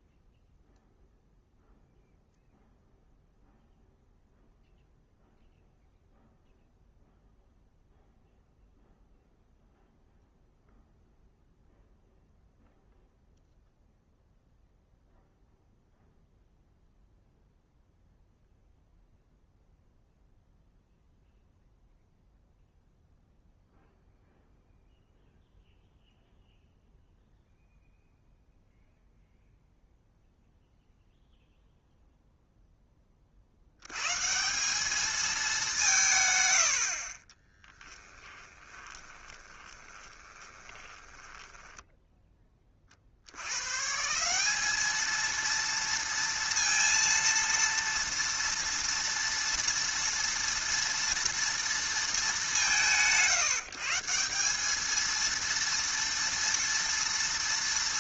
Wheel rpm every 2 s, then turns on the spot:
0, 0, 0, 0, 0, 0, 0, 0, 0, 0, 0, 0, 0, 0, 0, 0, 10, 190, 80, 20, 20, 30, 200, 230, 230, 230, 190, 200, 230.
38-42